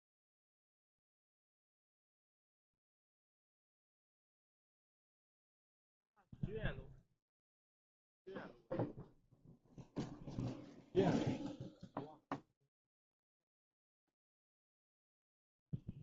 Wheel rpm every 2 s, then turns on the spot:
0, 0, 0, 0, 0, 0, 0, 0.
none